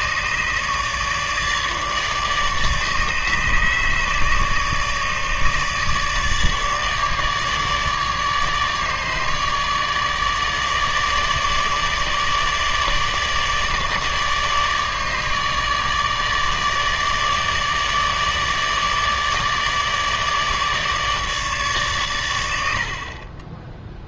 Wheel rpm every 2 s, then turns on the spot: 150, 150, 150, 150, 150, 150, 150, 150, 150, 150, 150, 80.
none